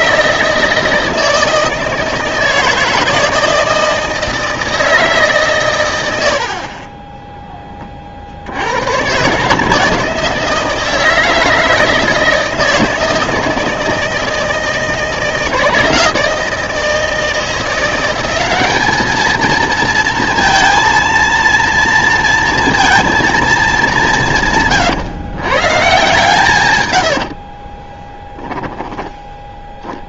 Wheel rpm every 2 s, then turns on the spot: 160, 160, 160, 50, 100, 160, 160, 160, 160, 210, 230, 230, 140, 130, 10.
none